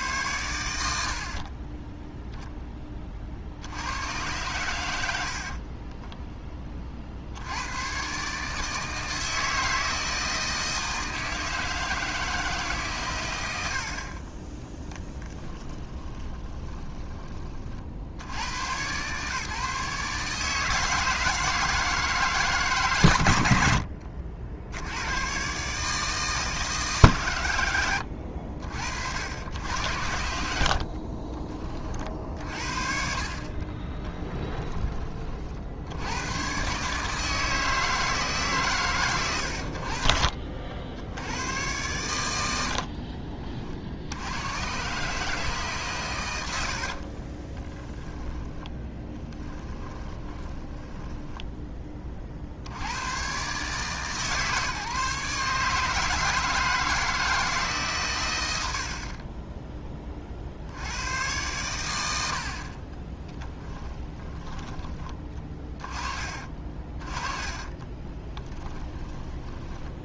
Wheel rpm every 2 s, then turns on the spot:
80, 20, 100, 30, 160, 160, 140, 10, 20, 120, 160, 130, 100, 140, 60, 60, 50, 20, 140, 130, 70, 60, 140, 80, 10, 20, 80, 150, 160, 70, 80, 40, 20, 30, 10.
4-6 14-18 46-52 66-70